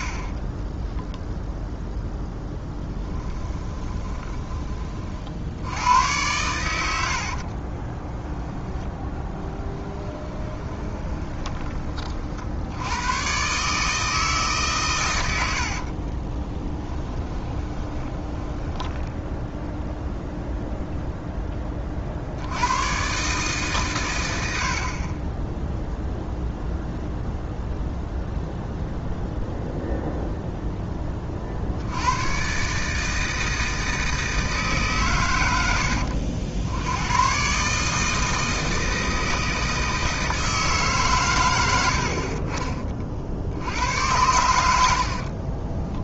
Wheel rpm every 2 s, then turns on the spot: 10, 10, 20, 100, 10, 20, 70, 140, 10, 20, 0, 90, 60, 0, 0, 10, 140, 150, 80, 160, 160, 30, 80.
0-4 8-12 16-20